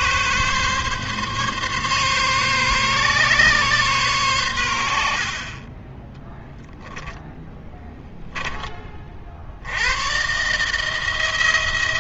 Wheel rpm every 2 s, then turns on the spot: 140, 140, 90, 10, 20, 150.
none